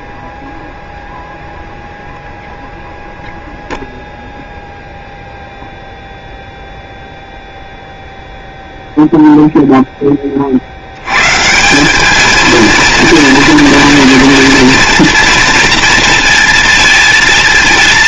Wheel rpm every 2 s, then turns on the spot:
0, 0, 0, 0, 0, 70, 230, 230, 230.
none